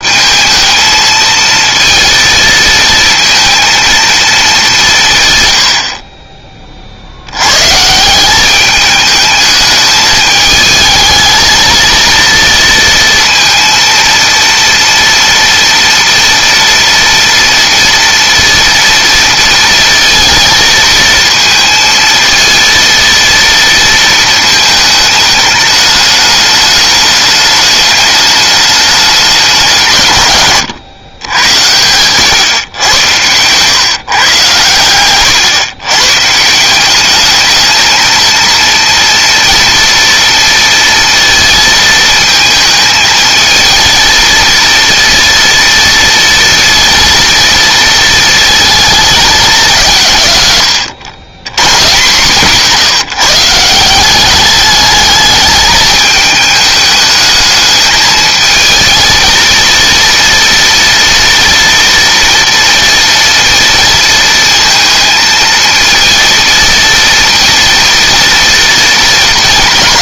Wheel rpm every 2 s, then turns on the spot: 220, 230, 130, 70, 210, 220, 230, 230, 230, 230, 230, 230, 210, 210, 200, 110, 110, 120, 200, 230, 230, 220, 230, 230, 220, 110, 150, 210, 210, 230, 230, 240, 230, 230, 230.
none